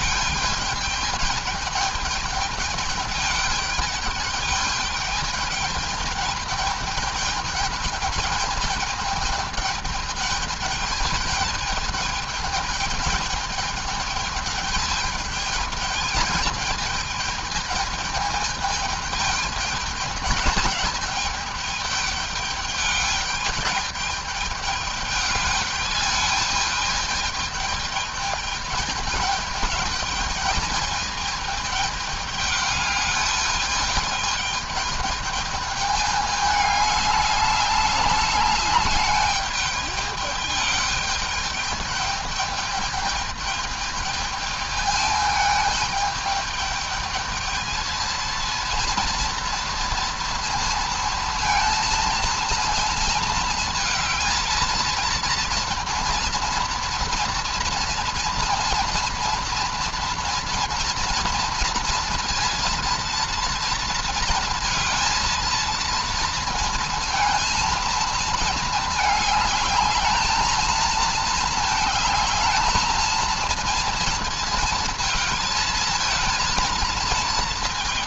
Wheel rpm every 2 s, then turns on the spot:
210, 220, 210, 210, 210, 210, 210, 210, 210, 210, 210, 210, 210, 210, 210, 220, 210, 210, 210, 210, 210, 210, 210, 210, 230, 230, 230, 230, 230, 230, 230, 230, 230, 220, 210, 220, 220, 230, 230.
none